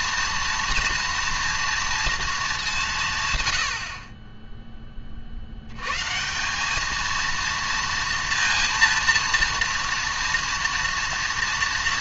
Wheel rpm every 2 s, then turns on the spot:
230, 200, 10, 190, 230, 230.
none